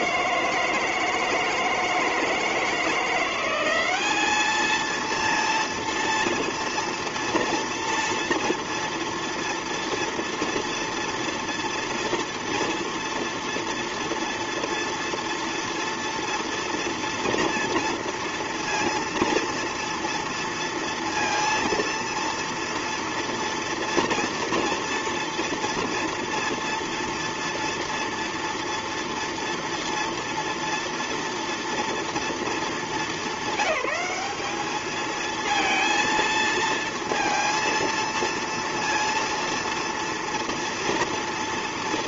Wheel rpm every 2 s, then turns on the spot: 160, 170, 230, 230, 230, 230, 230, 230, 230, 230, 230, 230, 230, 230, 230, 230, 210, 220, 230, 230, 230.
none